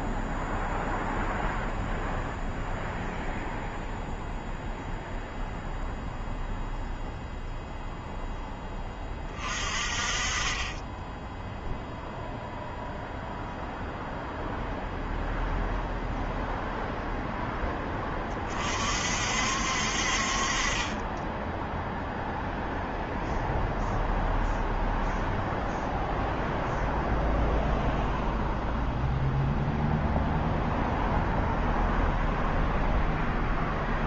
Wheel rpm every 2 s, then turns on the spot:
0, 0, 0, 0, 10, 30, 0, 0, 0, 30, 40, 0, 0, 0, 0, 0, 0.
none